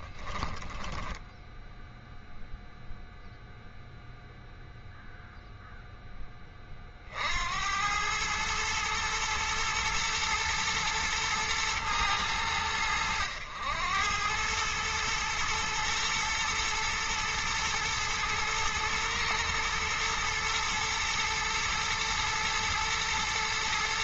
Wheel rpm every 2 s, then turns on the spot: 10, 0, 0, 40, 110, 120, 90, 110, 110, 110, 110, 110.
0-2